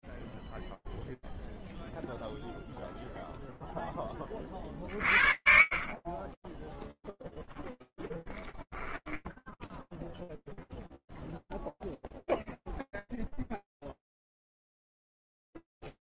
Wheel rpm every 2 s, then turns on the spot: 0, 0, 50, 0, 10, 0, 0, 0.
none